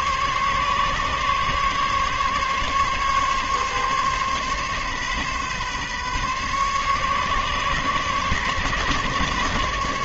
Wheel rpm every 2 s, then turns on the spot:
140, 140, 140, 140, 140.
none